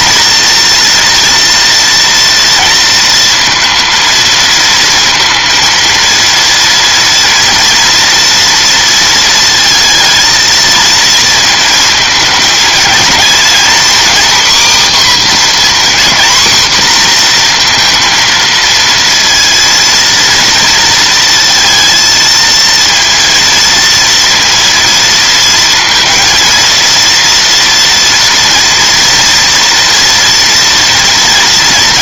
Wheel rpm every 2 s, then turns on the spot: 230, 230, 230, 230, 230, 230, 230, 270, 250, 230, 230, 230, 230, 230, 230, 230.
none